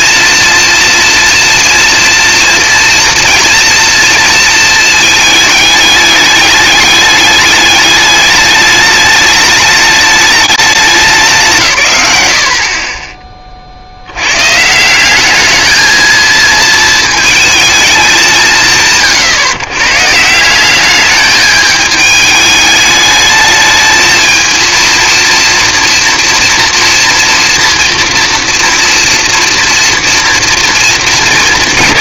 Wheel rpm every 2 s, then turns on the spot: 230, 230, 220, 210, 210, 200, 50, 140, 220, 170, 180, 210, 220, 230, 230, 230.
none